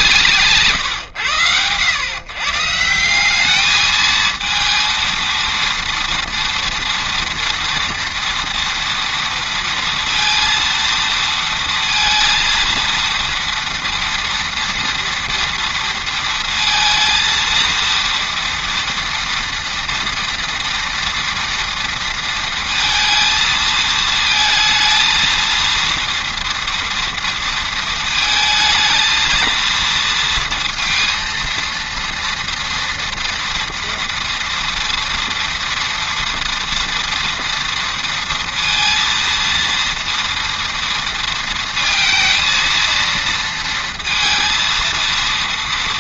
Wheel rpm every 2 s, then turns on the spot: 140, 150, 220, 230, 230, 230, 230, 230, 230, 230, 230, 230, 230, 230, 220, 230, 230, 240, 230, 230, 230, 230, 230.
0-2